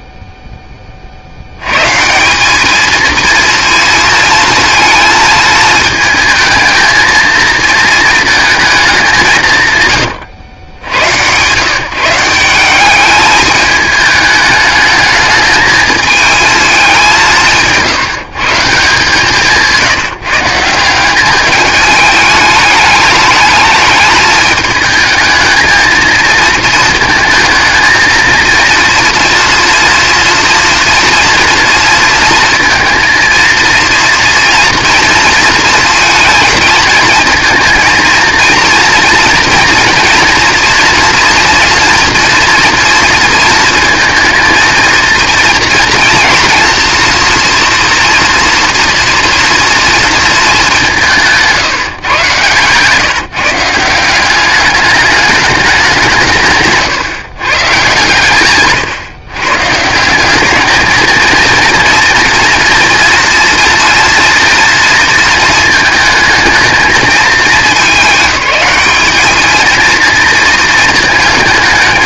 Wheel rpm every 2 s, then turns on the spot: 20, 220, 230, 230, 200, 100, 210, 210, 190, 160, 190, 210, 220, 220, 230, 230, 230, 230, 230, 230, 230, 230, 230, 230, 240, 170, 150, 210, 140, 130, 220, 230, 230, 220, 210, 220.
none